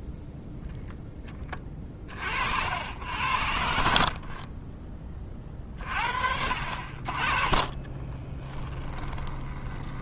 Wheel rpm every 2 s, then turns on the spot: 0, 70, 30, 40, 10.
8-10